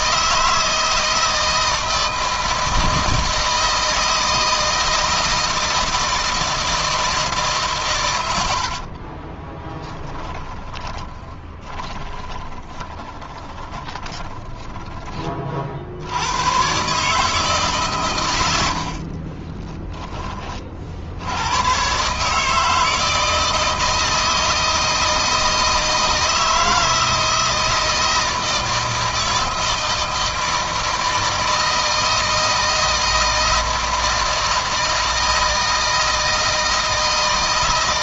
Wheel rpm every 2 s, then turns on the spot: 160, 160, 160, 160, 50, 20, 20, 20, 150, 40, 70, 160, 160, 160, 160, 160, 170, 160, 160.
8-14 18-20